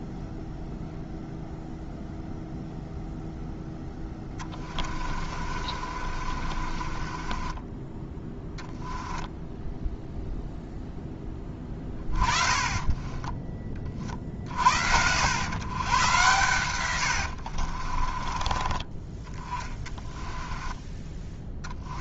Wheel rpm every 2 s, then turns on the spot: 0, 0, 30, 30, 10, 0, 20, 70, 100, 20, 10.
4-10 12-14 16-18